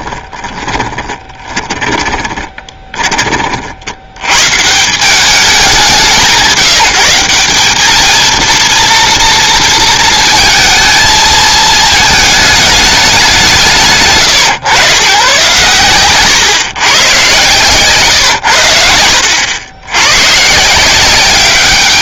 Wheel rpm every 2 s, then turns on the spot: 10, 20, 150, 170, 230, 220, 210, 120, 130, 80, 160.
0-4